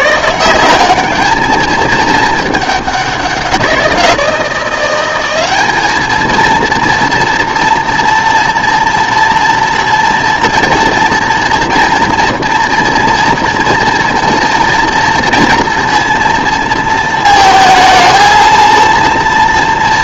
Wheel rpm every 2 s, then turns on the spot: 190, 210, 180, 230, 230, 230, 240, 230, 230, 230.
none